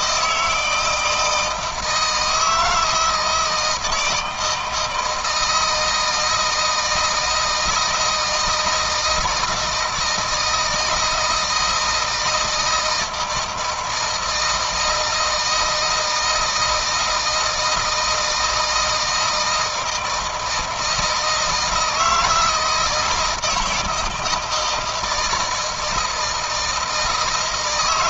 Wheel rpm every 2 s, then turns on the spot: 160, 160, 160, 160, 160, 170, 160, 160, 160, 160, 160, 160, 160, 160.
none